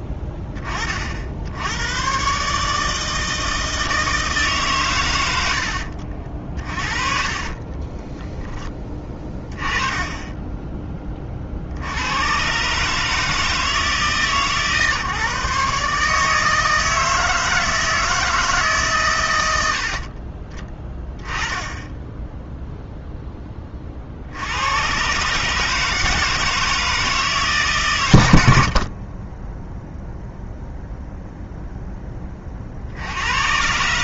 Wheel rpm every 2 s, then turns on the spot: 30, 150, 140, 40, 10, 10, 140, 140, 160, 140, 20, 0, 100, 160, 50, 0, 50.
none